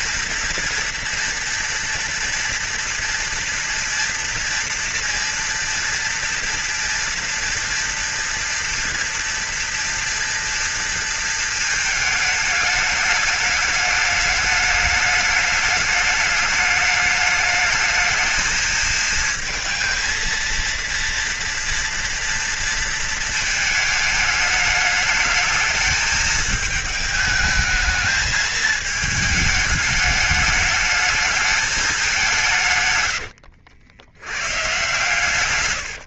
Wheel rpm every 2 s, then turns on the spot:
230, 240, 230, 230, 230, 230, 210, 210, 210, 220, 230, 230, 210, 220, 220, 210, 170, 100.
none